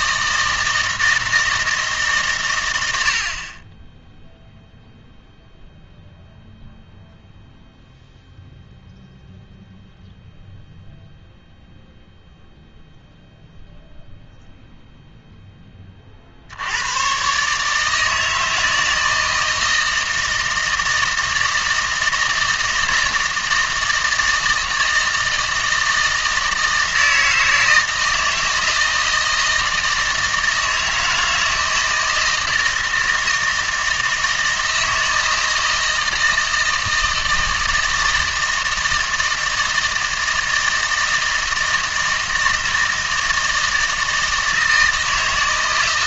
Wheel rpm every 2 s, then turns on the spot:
160, 110, 0, 0, 0, 0, 0, 0, 80, 160, 160, 160, 160, 160, 160, 160, 160, 160, 160, 160, 160, 160, 160.
none